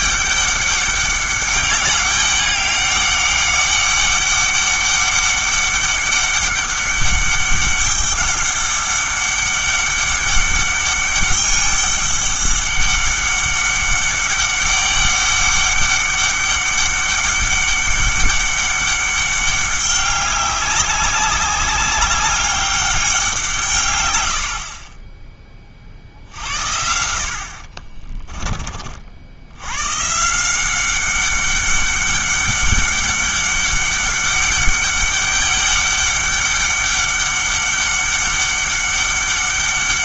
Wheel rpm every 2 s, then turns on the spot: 200, 200, 200, 200, 200, 200, 200, 200, 200, 200, 190, 200, 40, 60, 40, 190, 200, 200, 200, 200.
none